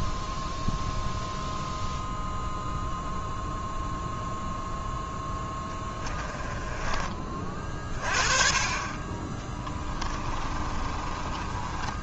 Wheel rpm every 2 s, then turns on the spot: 0, 0, 0, 20, 30, 30.
10-12